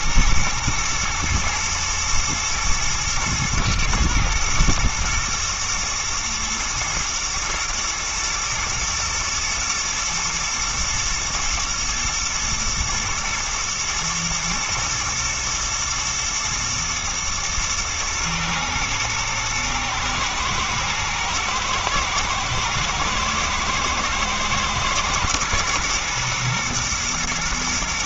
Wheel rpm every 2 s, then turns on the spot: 120, 110, 120, 110, 110, 110, 110, 120, 120, 120, 120, 110, 110, 120.
none